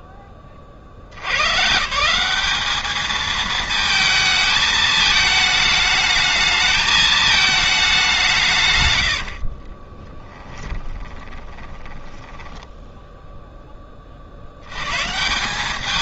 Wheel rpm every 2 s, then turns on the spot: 50, 210, 220, 220, 140, 20, 10, 100.
10-14